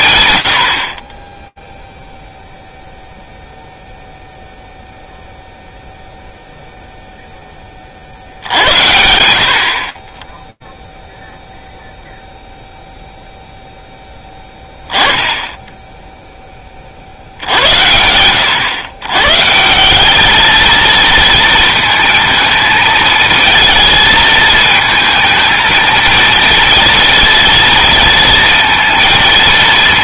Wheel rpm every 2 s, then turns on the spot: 60, 0, 0, 0, 70, 0, 0, 10, 30, 100, 230, 220, 220, 230, 230.
none